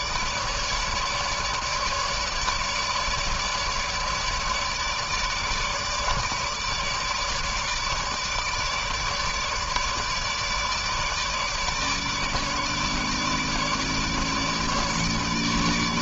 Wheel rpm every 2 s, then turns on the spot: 150, 150, 150, 150, 150, 150, 150, 150.
none